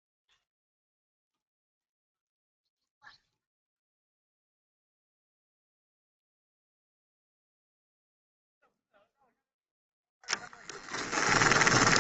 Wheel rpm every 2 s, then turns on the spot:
0, 0, 0, 0, 0, 10.
10-12